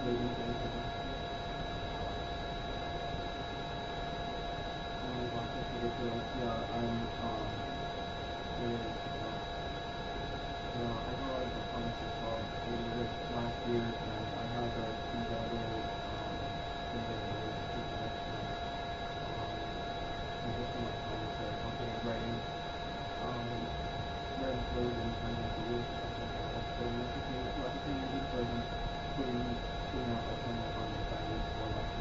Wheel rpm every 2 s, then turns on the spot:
0, 0, 0, 0, 0, 0, 0, 0, 0, 0, 0, 0, 0, 0, 0, 0.
none